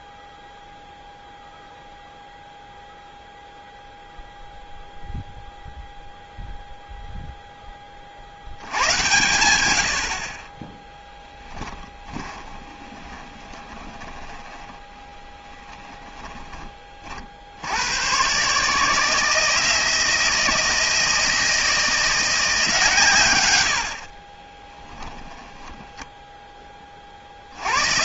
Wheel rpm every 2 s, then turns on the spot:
0, 0, 0, 0, 80, 20, 20, 20, 10, 140, 160, 170, 30, 10.
12-16 24-26